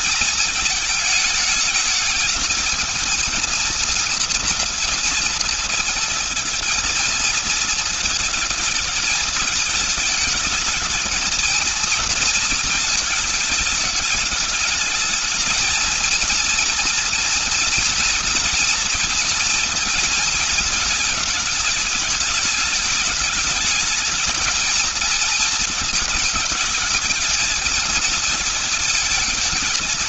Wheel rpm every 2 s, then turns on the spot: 220, 220, 230, 230, 220, 220, 230, 210, 230, 230, 220, 210, 220, 220, 230.
none